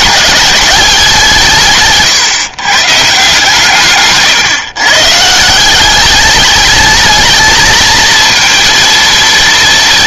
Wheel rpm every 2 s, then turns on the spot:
190, 140, 140, 220, 230.
none